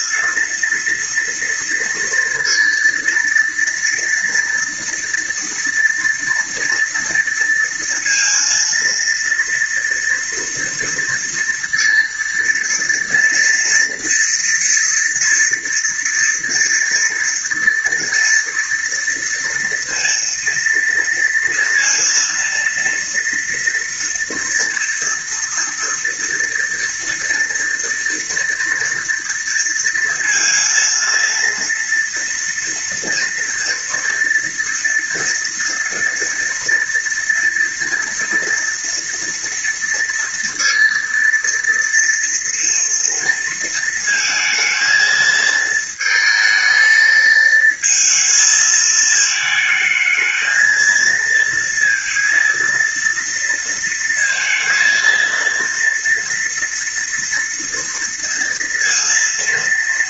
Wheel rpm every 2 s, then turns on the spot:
230, 230, 230, 230, 230, 230, 230, 240, 230, 230, 230, 230, 240, 230, 230, 230, 230, 230, 230, 230, 230, 230, 230, 220, 220, 220, 230, 230, 230, 230.
none